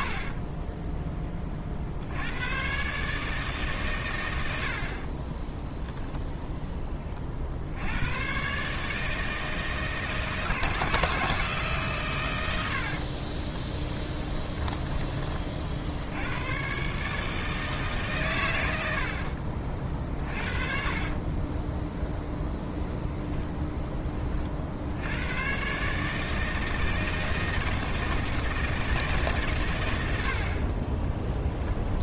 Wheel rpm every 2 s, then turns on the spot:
20, 140, 50, 20, 150, 160, 60, 20, 140, 80, 30, 0, 80, 160, 160, 40.
0-2 12-14 20-22 30-32